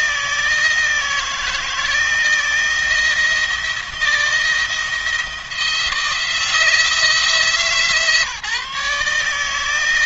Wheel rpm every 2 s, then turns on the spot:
160, 160, 170, 160, 150.
none